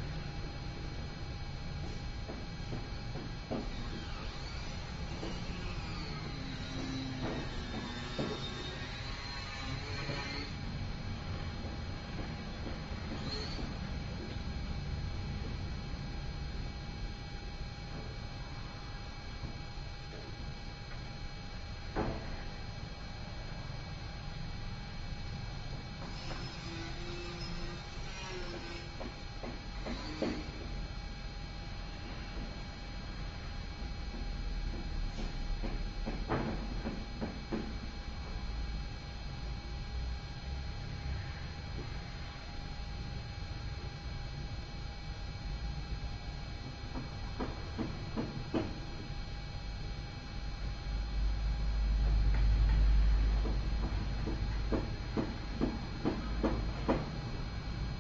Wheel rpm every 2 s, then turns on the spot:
0, 0, 0, 0, 0, 0, 0, 0, 0, 0, 0, 0, 0, 0, 0, 0, 0, 0, 0, 0, 0, 0, 0, 0, 0, 0, 0, 0, 0.
none